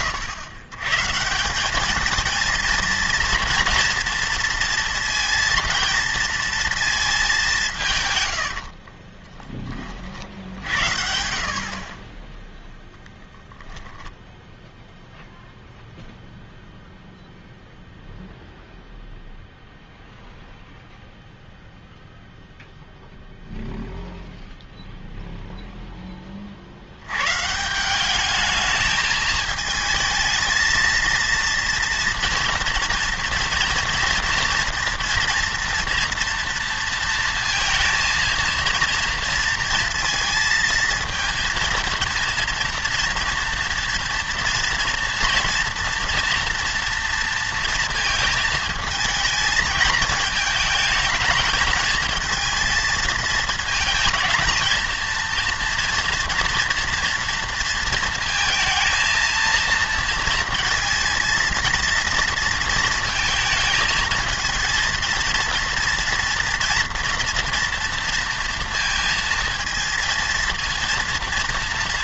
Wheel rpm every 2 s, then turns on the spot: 120, 230, 230, 230, 70, 70, 0, 0, 0, 0, 0, 0, 0, 60, 220, 220, 230, 230, 230, 230, 220, 230, 230, 240, 220, 220, 220, 230, 230, 230, 230, 230, 220, 230, 230, 230.
8-10